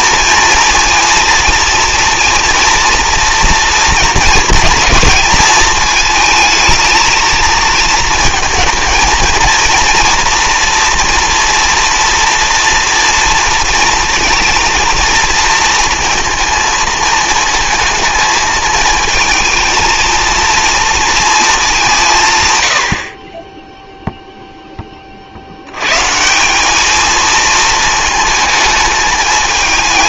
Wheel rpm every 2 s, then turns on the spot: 230, 240, 230, 220, 230, 230, 240, 230, 220, 220, 230, 100, 10, 200, 210.
none